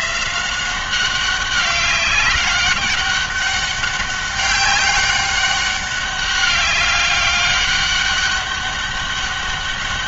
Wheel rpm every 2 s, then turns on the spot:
180, 200, 200, 200, 200.
none